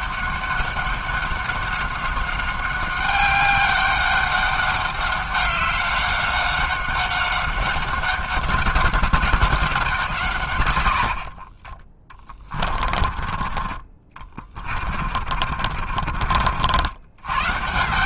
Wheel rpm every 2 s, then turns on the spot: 200, 190, 200, 190, 190, 140, 30, 40, 60.
12-16